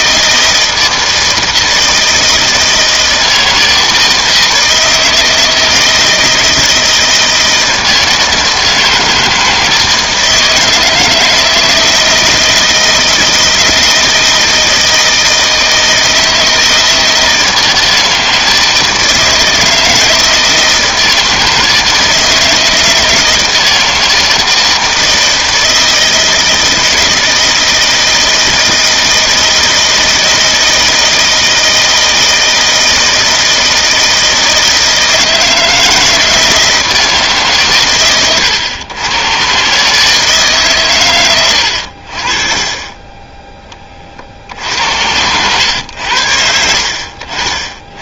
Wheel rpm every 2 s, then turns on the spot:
160, 160, 160, 160, 160, 160, 160, 160, 160, 160, 160, 160, 160, 160, 160, 160, 160, 160, 160, 110, 150, 40, 60, 70.
none